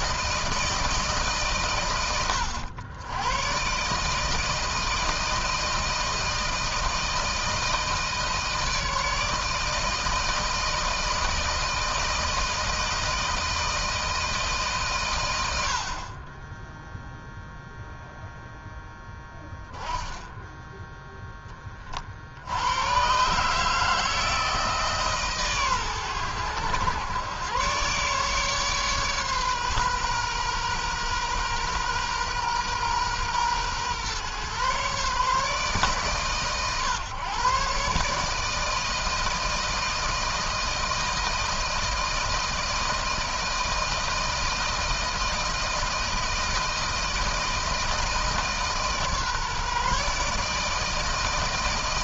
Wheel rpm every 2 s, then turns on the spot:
160, 100, 160, 160, 160, 160, 160, 150, 20, 0, 10, 100, 150, 110, 140, 130, 120, 130, 130, 160, 160, 160, 160, 160, 150, 150.
none